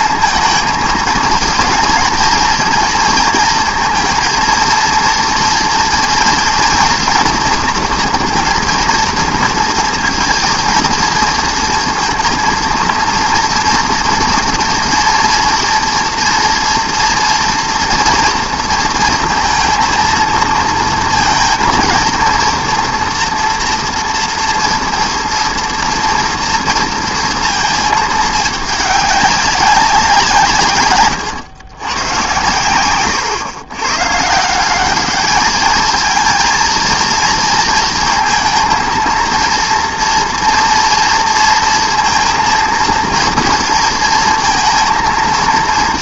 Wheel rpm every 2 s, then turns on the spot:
230, 230, 230, 230, 230, 230, 230, 240, 240, 230, 230, 230, 240, 230, 200, 120, 110, 210, 230, 230, 230, 230, 230.
none